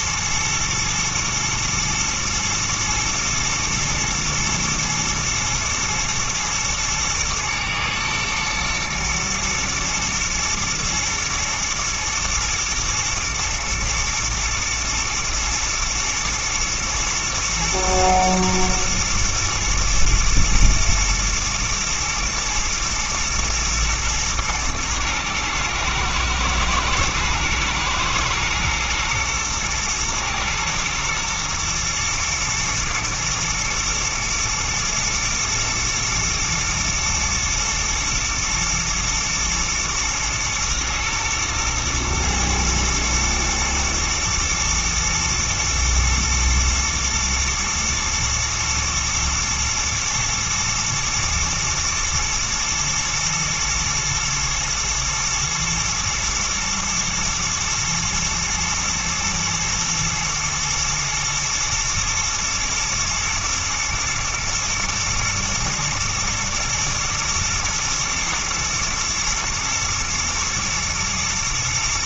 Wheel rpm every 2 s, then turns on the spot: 110, 120, 110, 120, 110, 110, 110, 110, 110, 110, 120, 110, 110, 110, 120, 120, 110, 110, 120, 110, 120, 120, 110, 110, 110, 110, 120, 110, 110, 110, 110, 120, 110, 120, 120, 110.
none